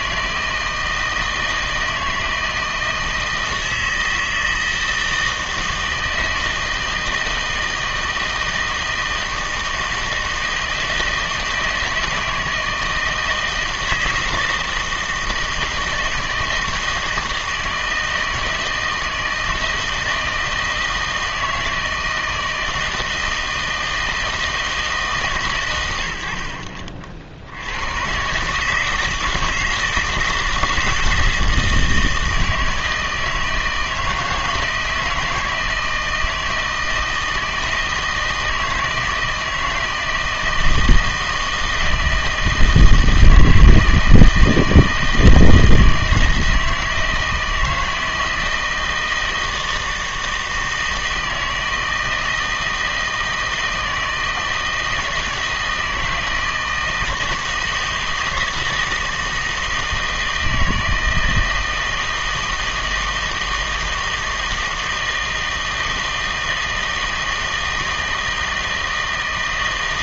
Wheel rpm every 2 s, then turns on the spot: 160, 160, 160, 160, 160, 160, 160, 160, 160, 160, 160, 160, 160, 60, 150, 160, 160, 160, 160, 160, 160, 160, 160, 160, 160, 160, 160, 160, 160, 160, 160, 160, 160, 160, 160.
none